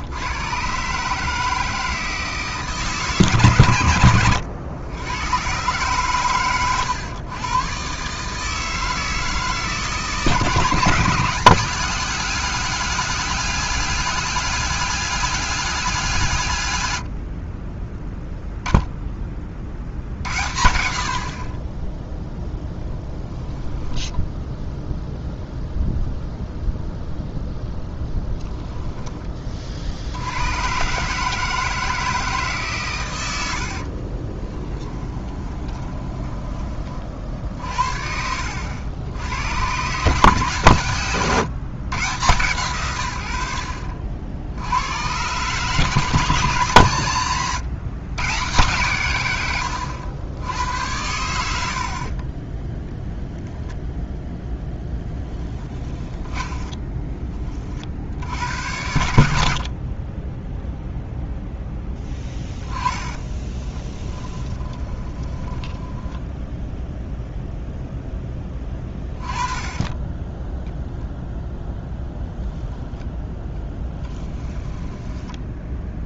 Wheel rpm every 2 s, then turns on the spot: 140, 150, 100, 120, 160, 160, 190, 200, 100, 0, 60, 10, 0, 0, 10, 130, 130, 20, 30, 80, 130, 120, 100, 140, 140, 80, 0, 0, 10, 90, 0, 10, 20, 0, 20, 0, 0, 10.
28-30 34-36 56-58 64-66 74-76